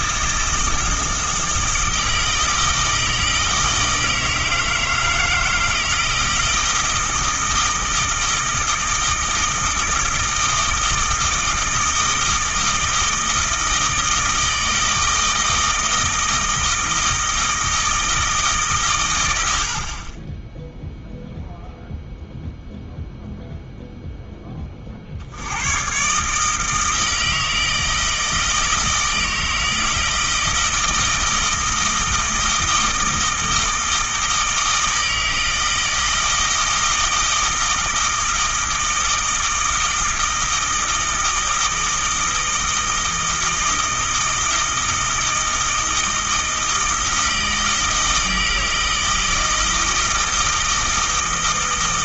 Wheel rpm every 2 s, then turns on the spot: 160, 160, 160, 160, 160, 160, 160, 160, 160, 140, 0, 0, 20, 160, 160, 160, 160, 160, 160, 160, 160, 160, 160, 160, 160, 160.
none